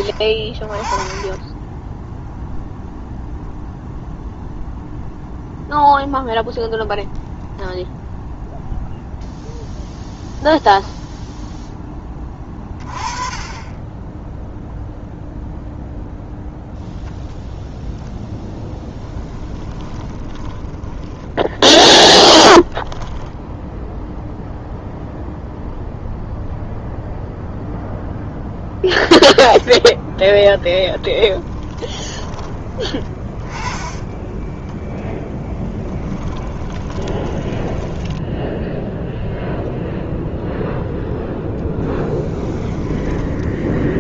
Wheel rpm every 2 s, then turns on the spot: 20, 0, 0, 0, 0, 0, 20, 0, 0, 10, 20, 20, 0, 0, 10, 20, 20, 10, 20, 0, 0, 10.
20-24 28-34 36-38 42-44